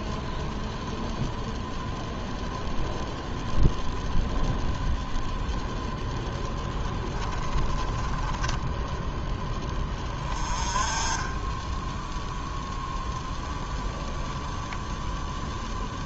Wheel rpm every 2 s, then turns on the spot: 0, 0, 0, 10, 10, 20, 0, 0.
6-8